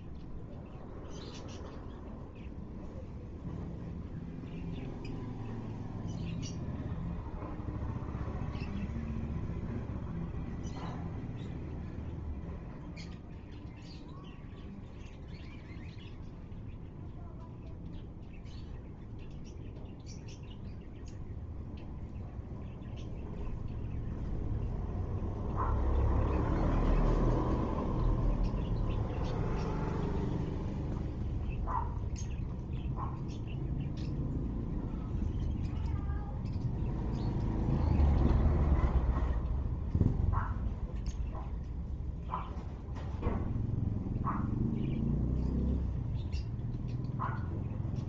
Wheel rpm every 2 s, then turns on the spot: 0, 0, 0, 0, 0, 0, 0, 0, 0, 0, 0, 0, 0, 0, 0, 0, 0, 0, 0, 0, 0, 0, 0, 0.
none